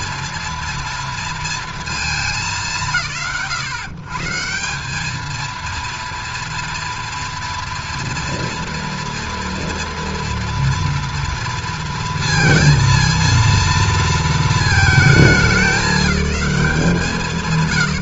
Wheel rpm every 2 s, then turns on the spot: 120, 220, 230, 230, 230, 230, 200, 130, 20.
16-18